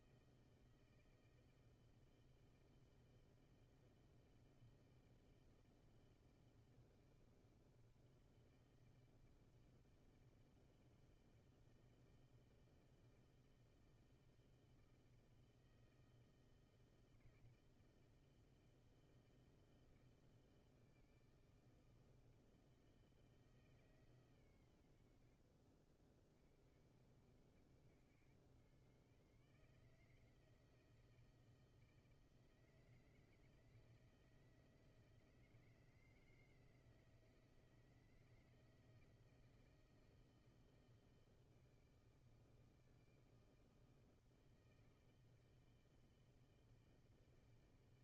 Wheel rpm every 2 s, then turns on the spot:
160, 160, 160, 160, 160, 160, 160, 160, 160, 160, 160, 160, 120, 80, 120, 160, 160, 160, 160, 160, 160, 160, 160, 160.
none